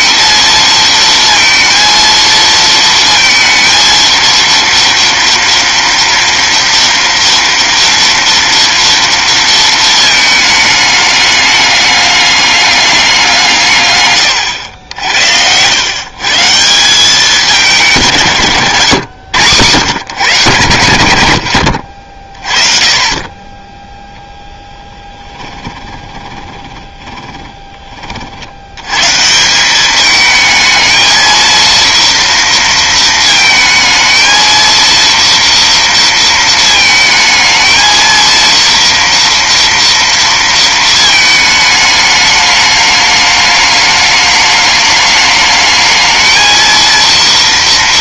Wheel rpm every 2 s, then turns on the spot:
230, 230, 230, 230, 230, 210, 200, 90, 170, 130, 120, 30, 10, 20, 80, 220, 230, 230, 220, 230, 230, 210, 210, 230.
26-28